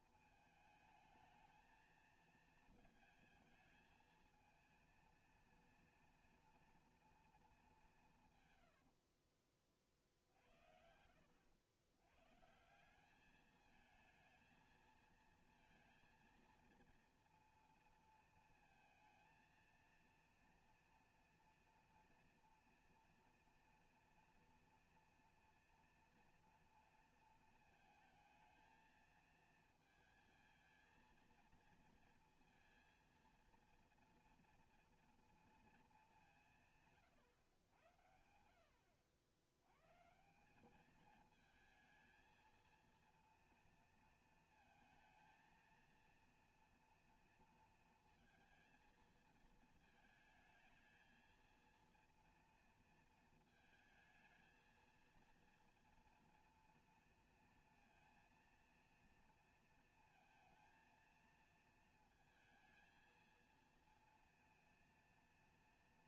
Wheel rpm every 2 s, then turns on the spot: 220, 220, 220, 230, 160, 60, 120, 220, 230, 230, 230, 230, 230, 240, 220, 220, 230, 230, 190, 80, 170, 220, 230, 230, 230, 220, 230, 230, 240, 230, 230, 220, 230.
none